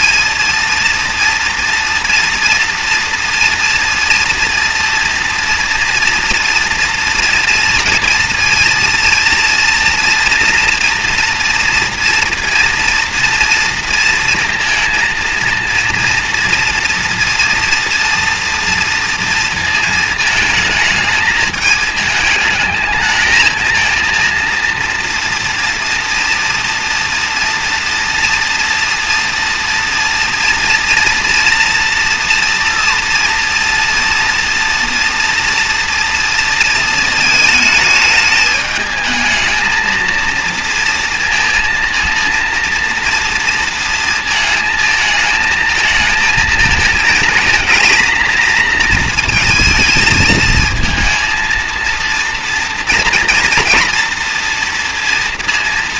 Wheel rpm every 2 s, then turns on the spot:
230, 230, 230, 230, 230, 230, 230, 230, 230, 230, 220, 220, 230, 240, 240, 230, 230, 230, 220, 220, 230, 230, 220, 220, 230, 230, 230, 230.
none